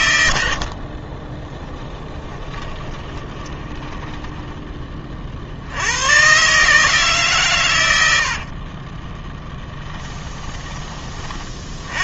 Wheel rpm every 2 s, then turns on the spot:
50, 20, 30, 150, 30, 30.
0-4 8-10